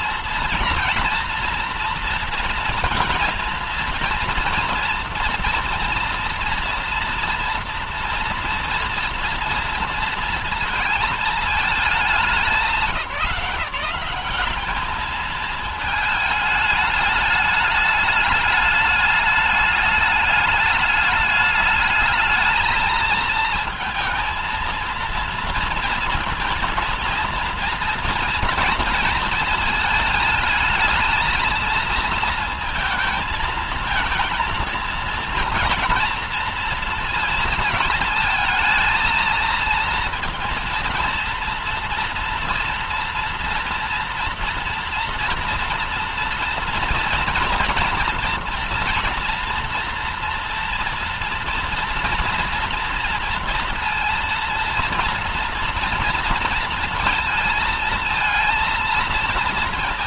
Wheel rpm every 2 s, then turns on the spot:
240, 240, 240, 240, 230, 230, 200, 210, 210, 210, 210, 220, 230, 230, 230, 220, 230, 230, 230, 230, 230, 230, 230, 230, 230, 230, 230, 230, 230, 230.
none